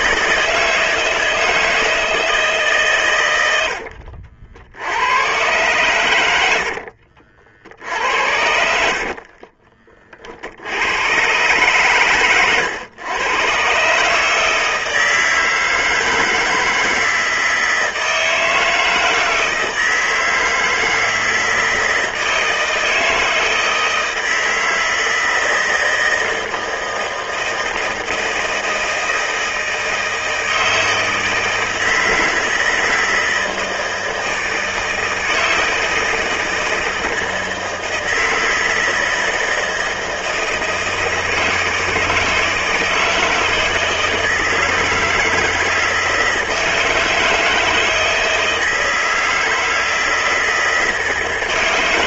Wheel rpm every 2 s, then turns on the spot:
160, 140, 80, 60, 60, 90, 110, 160, 160, 160, 160, 160, 160, 160, 160, 160, 160, 160, 160, 160, 160, 160, 160, 160, 160, 160.
6-10